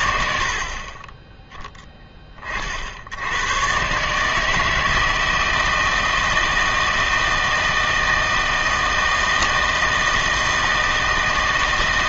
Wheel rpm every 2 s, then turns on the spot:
40, 60, 160, 160, 160, 160.
none